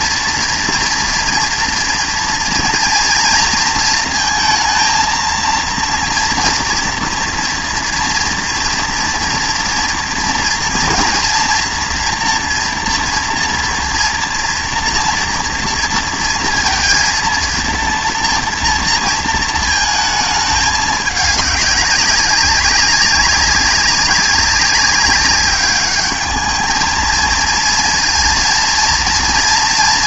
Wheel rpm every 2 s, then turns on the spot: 230, 230, 230, 230, 230, 230, 230, 230, 230, 230, 210, 200, 190, 210, 230.
none